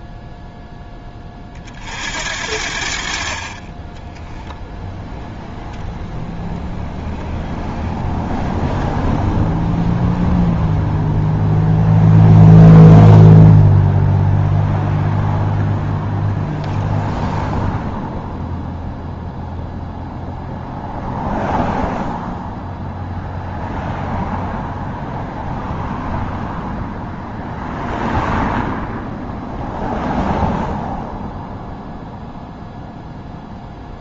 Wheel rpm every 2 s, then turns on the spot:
10, 60, 0, 0, 0, 0, 0, 0, 0, 0, 0, 0, 0, 0, 0, 0, 0.
none